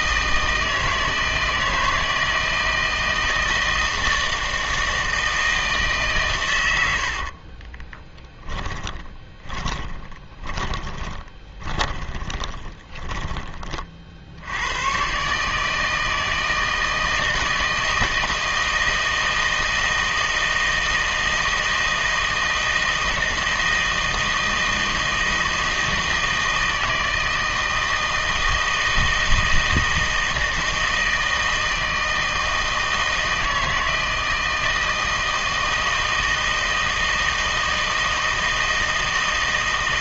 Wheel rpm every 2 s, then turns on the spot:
160, 160, 160, 80, 20, 20, 20, 110, 160, 160, 160, 160, 160, 160, 160, 160, 160, 160, 160, 160.
6-14